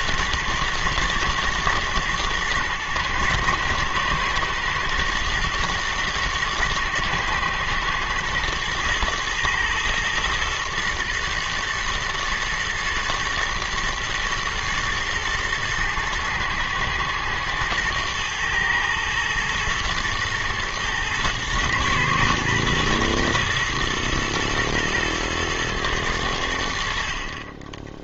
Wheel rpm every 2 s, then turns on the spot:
120, 120, 120, 110, 120, 120, 110, 110, 110, 110, 120, 120, 120, 70.
none